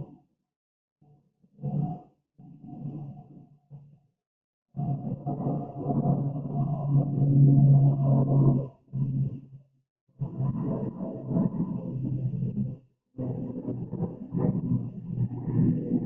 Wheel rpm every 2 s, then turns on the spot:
0, 0, 0, 0, 0, 0, 0, 0.
none